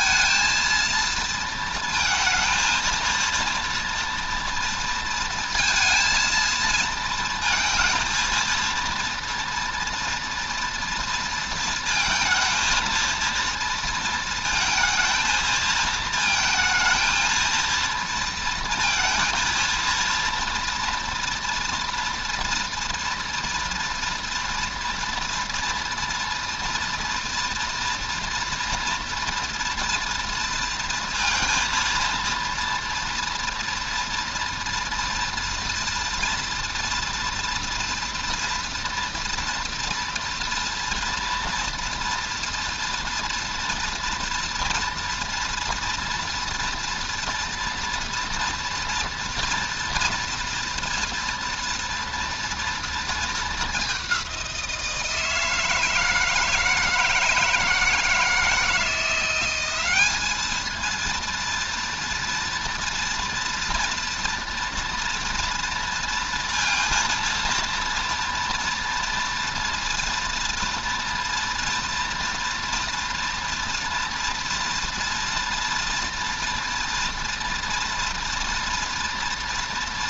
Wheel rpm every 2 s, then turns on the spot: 230, 230, 230, 230, 230, 230, 230, 230, 230, 230, 230, 230, 230, 230, 240, 230, 230, 230, 230, 230, 230, 240, 230, 230, 240, 240, 230, 170, 160, 160, 220, 230, 230, 230, 230, 230, 230, 230, 240, 230.
none